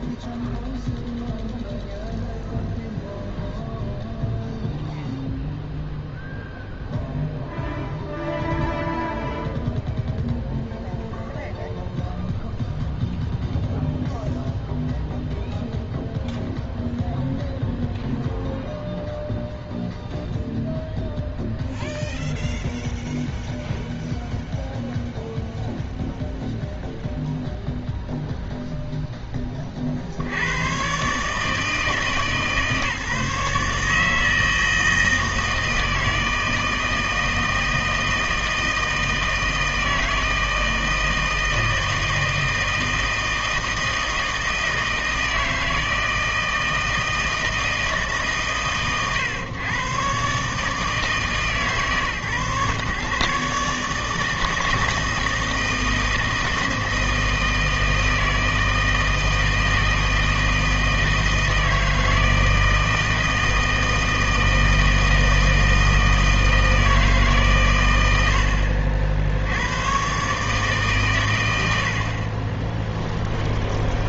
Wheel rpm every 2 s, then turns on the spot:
0, 0, 0, 0, 0, 0, 0, 0, 0, 0, 0, 0, 0, 0, 0, 100, 150, 160, 160, 160, 160, 160, 160, 160, 130, 140, 140, 160, 160, 160, 160, 160, 160, 160, 60, 140, 30.
none